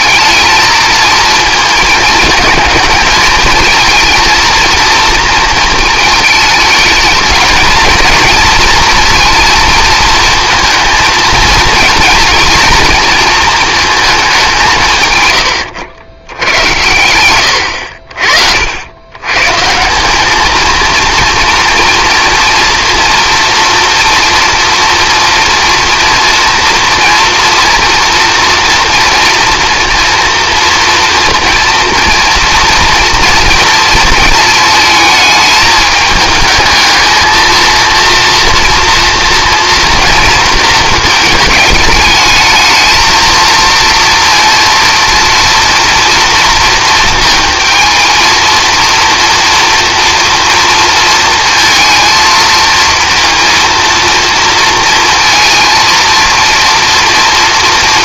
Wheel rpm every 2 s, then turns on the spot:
220, 220, 220, 210, 230, 220, 230, 160, 100, 70, 220, 230, 240, 230, 230, 240, 230, 220, 220, 230, 220, 220, 230, 230, 230, 230, 230, 230, 230.
none